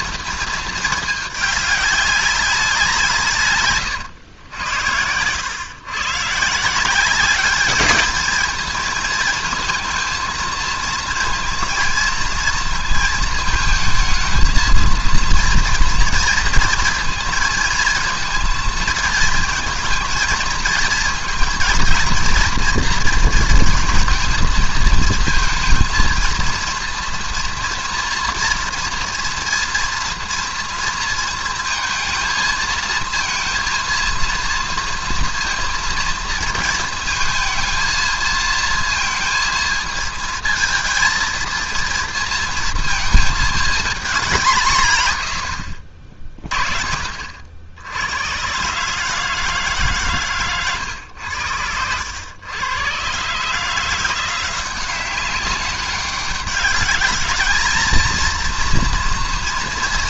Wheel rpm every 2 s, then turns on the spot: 230, 190, 90, 160, 220, 230, 230, 220, 230, 220, 220, 230, 220, 230, 230, 230, 230, 230, 230, 230, 220, 230, 170, 30, 130, 130, 110, 180, 200, 240.
none